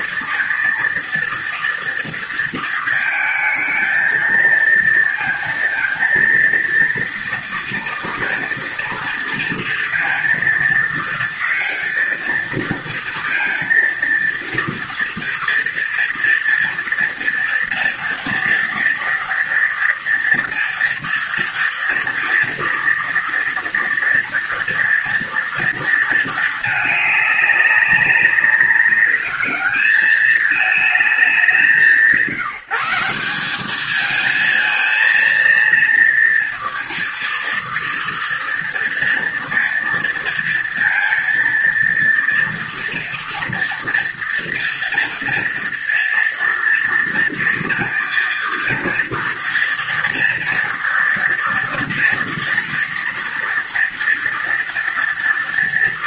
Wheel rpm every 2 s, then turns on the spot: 230, 220, 230, 230, 230, 230, 230, 240, 230, 230, 240, 230, 230, 200, 200, 200, 190, 230, 230, 230, 230, 230, 230, 230, 230, 230, 230, 240.
none